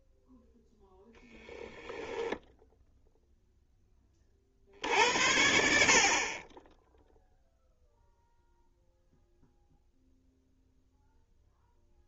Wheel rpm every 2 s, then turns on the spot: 10, 0, 70, 10, 0, 0.
none